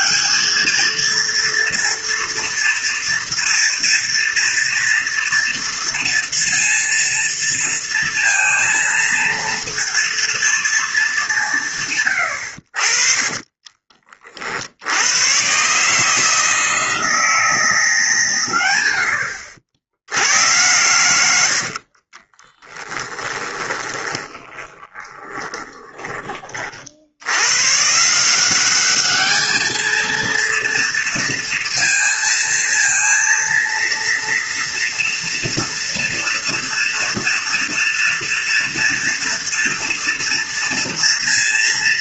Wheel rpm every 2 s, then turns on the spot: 220, 230, 230, 230, 230, 220, 60, 70, 160, 90, 110, 10, 20, 60, 200, 230, 230, 230, 230, 230, 230.
22-26